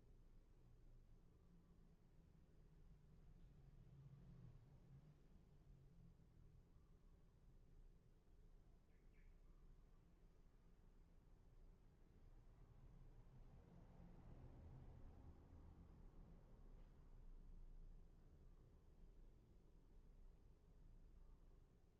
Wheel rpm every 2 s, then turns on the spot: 0, 0, 0, 0, 0, 0, 0, 0, 0, 0, 0.
none